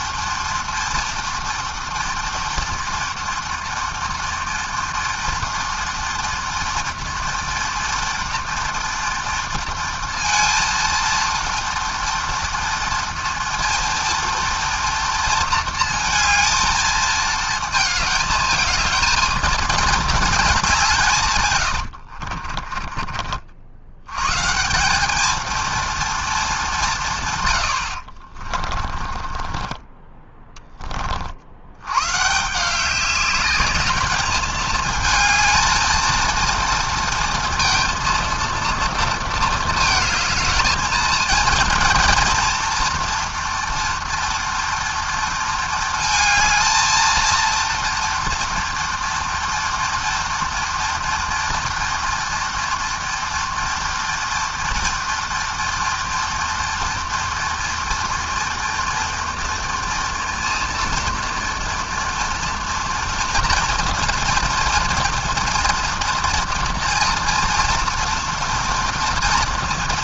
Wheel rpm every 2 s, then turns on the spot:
230, 230, 230, 230, 230, 230, 240, 230, 220, 220, 140, 40, 220, 140, 30, 50, 200, 220, 230, 220, 230, 240, 230, 230, 230, 230, 240, 230, 230, 230, 230, 230, 230, 230, 230.
28-30